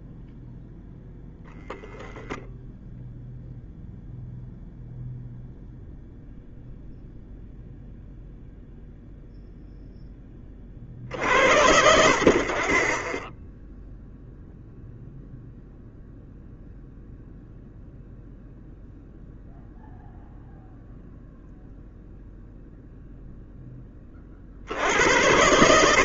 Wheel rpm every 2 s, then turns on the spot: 10, 0, 0, 0, 0, 60, 30, 0, 0, 0, 0, 0, 80.
none